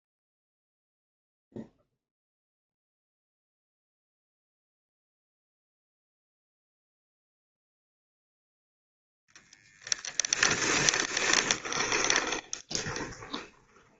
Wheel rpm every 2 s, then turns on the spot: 0, 0, 0, 0, 0, 20, 20.
10-14